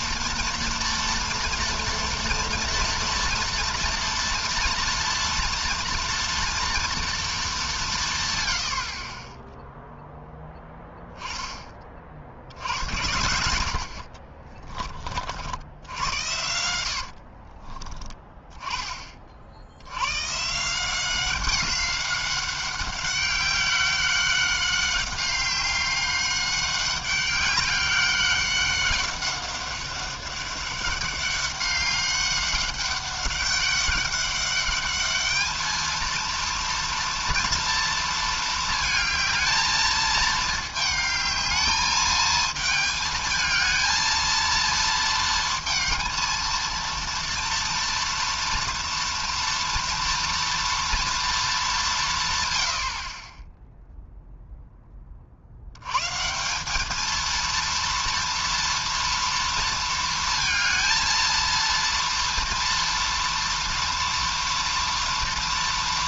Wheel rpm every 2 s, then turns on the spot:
230, 230, 230, 230, 120, 10, 70, 30, 100, 20, 140, 200, 190, 200, 190, 200, 200, 200, 230, 220, 220, 220, 230, 230, 230, 230, 110, 0, 170, 230, 230, 230, 230.
10-12 14-16